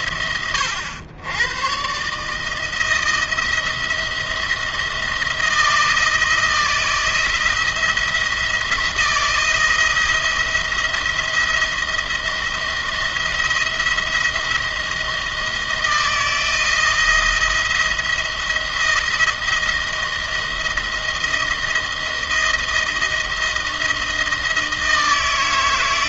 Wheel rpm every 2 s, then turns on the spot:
90, 160, 170, 160, 170, 170, 160, 170, 170, 160, 160, 170, 160.
none